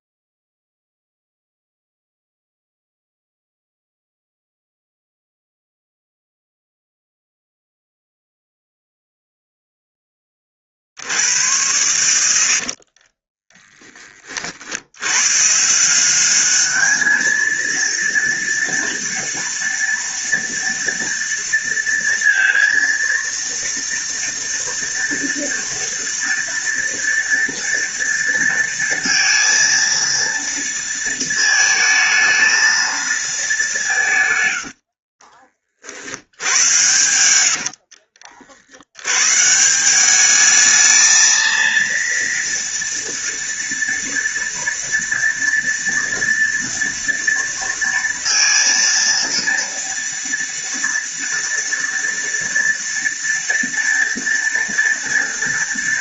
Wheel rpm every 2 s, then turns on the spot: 0, 0, 0, 0, 0, 80, 30, 90, 220, 230, 230, 230, 230, 230, 230, 230, 220, 50, 90, 110, 220, 230, 230, 230, 230, 230, 230, 230.
12-14 34-38